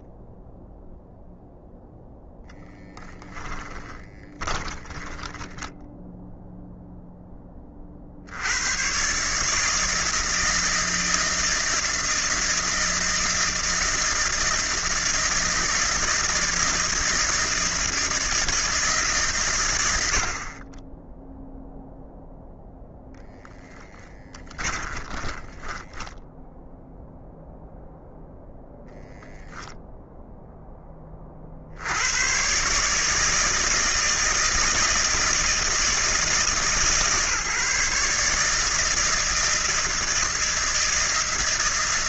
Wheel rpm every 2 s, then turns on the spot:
0, 10, 20, 0, 100, 160, 160, 160, 160, 150, 20, 0, 20, 0, 0, 10, 140, 160, 140, 160, 160.
4-6 24-26